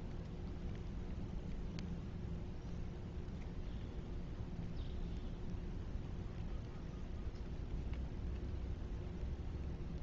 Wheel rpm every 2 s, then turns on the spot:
0, 0, 0, 0, 0.
none